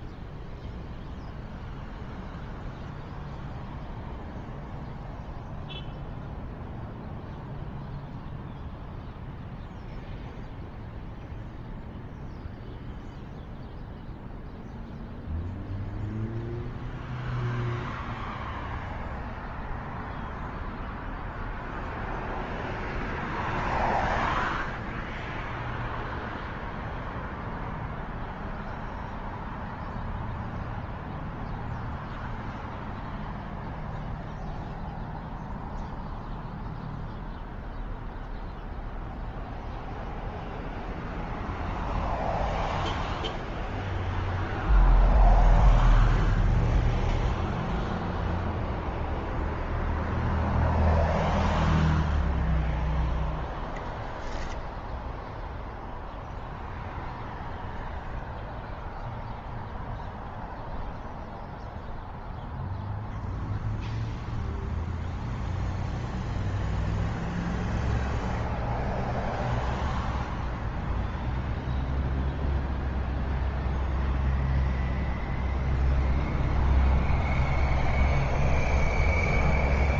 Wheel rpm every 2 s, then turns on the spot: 0, 0, 0, 0, 0, 0, 0, 0, 0, 0, 0, 0, 0, 0, 0, 0, 0, 0, 0, 0, 0, 0, 0, 0, 0, 0, 0, 0, 0, 0, 0, 0, 0, 0, 0, 0, 0, 0, 0, 0.
none